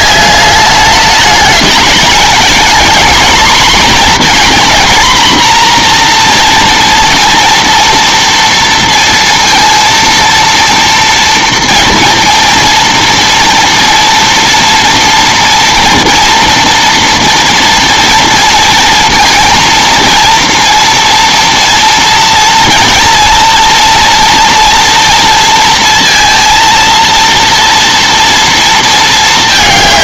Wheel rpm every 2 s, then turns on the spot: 200, 240, 250, 240, 230, 230, 230, 240, 240, 230, 230, 230, 230, 230, 230.
none